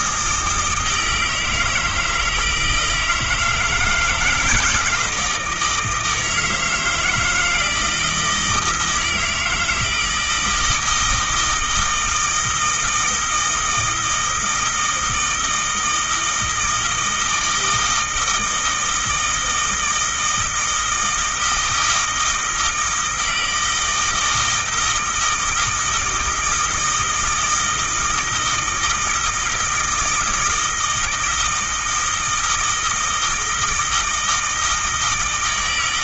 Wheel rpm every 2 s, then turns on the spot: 160, 160, 160, 160, 160, 160, 160, 160, 160, 160, 160, 160, 160, 160, 160, 160, 160, 160.
none